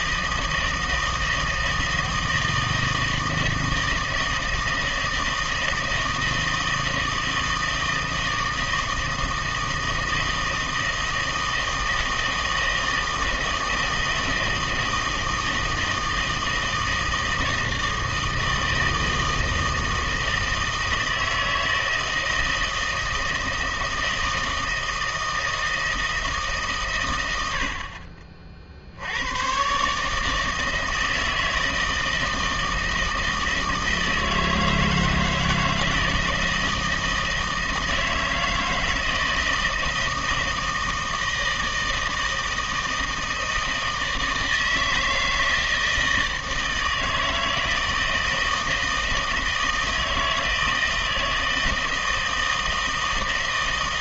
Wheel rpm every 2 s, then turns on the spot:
160, 160, 160, 160, 160, 160, 160, 160, 160, 160, 160, 160, 160, 140, 50, 160, 160, 160, 160, 160, 160, 160, 160, 160, 160, 160, 160.
none